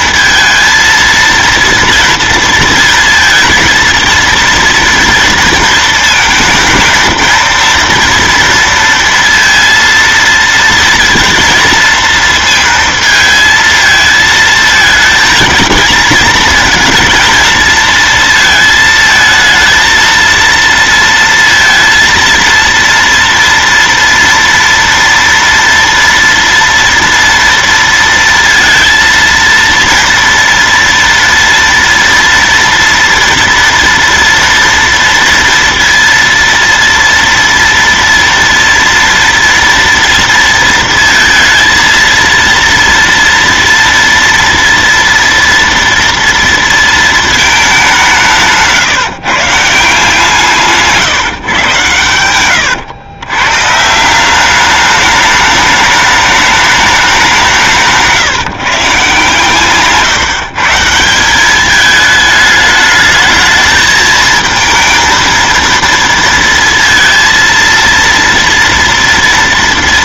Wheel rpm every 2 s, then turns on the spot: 230, 220, 230, 230, 230, 230, 230, 220, 220, 230, 230, 230, 230, 230, 230, 230, 230, 230, 230, 230, 230, 230, 230, 230, 160, 160, 100, 200, 210, 150, 150, 210, 220, 230, 230.
none